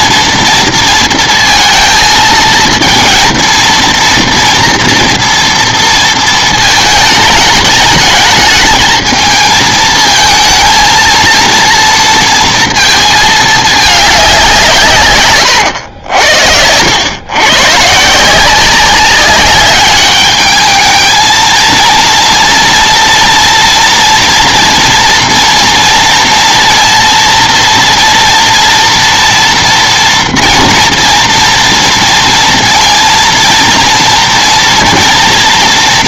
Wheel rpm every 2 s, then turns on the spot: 230, 220, 230, 220, 220, 230, 230, 170, 80, 180, 210, 230, 230, 230, 230, 230, 230, 240.
16-18